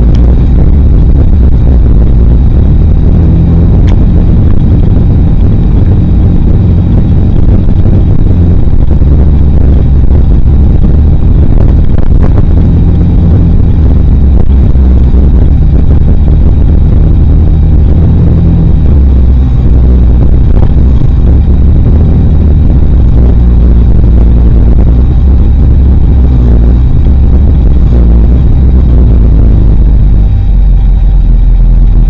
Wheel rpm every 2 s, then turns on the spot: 0, 0, 0, 0, 0, 0, 0, 0, 0, 0, 0, 0, 0, 0, 0, 0.
none